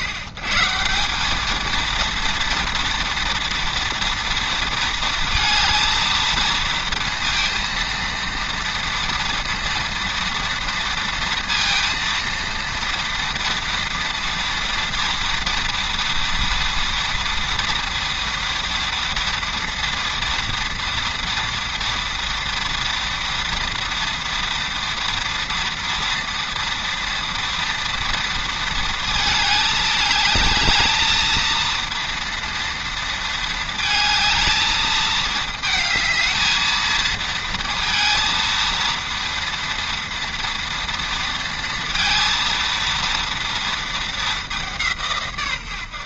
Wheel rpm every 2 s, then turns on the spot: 130, 230, 230, 230, 230, 230, 230, 230, 230, 240, 230, 230, 230, 230, 230, 210, 230, 220, 220, 230, 230, 230, 190.
none